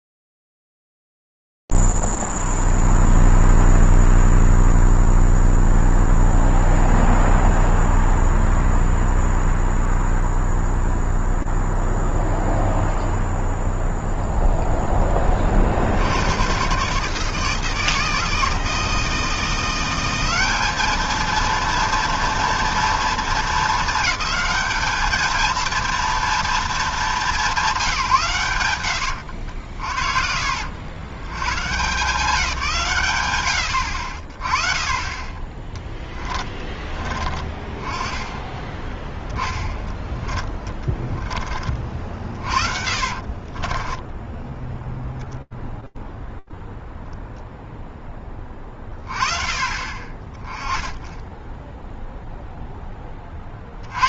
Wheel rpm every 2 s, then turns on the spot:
0, 0, 0, 0, 0, 0, 0, 10, 130, 160, 220, 220, 220, 210, 80, 150, 120, 20, 20, 10, 20, 30, 0, 0, 30, 0, 20.
28-30 38-40 42-44